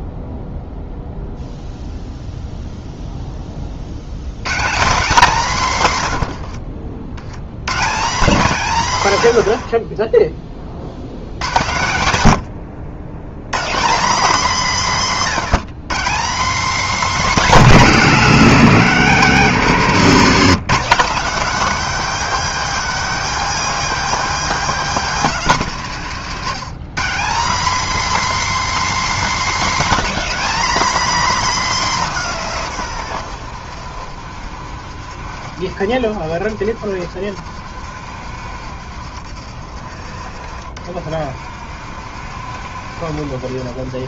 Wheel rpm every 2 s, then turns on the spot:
0, 0, 160, 80, 170, 50, 80, 190, 220, 220, 210, 260, 250, 190, 270, 240, 140, 60, 60, 60, 60, 70.
6-8